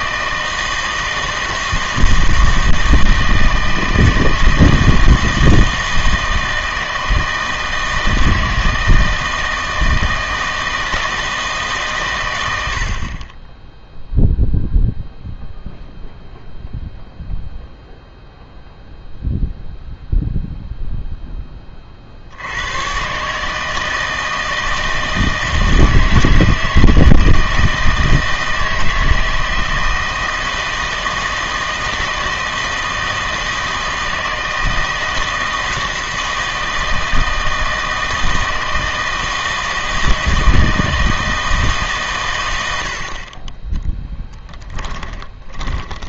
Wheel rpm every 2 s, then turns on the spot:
160, 160, 160, 160, 160, 160, 90, 0, 0, 0, 0, 100, 160, 160, 160, 160, 160, 160, 160, 160, 160, 90, 10.
44-46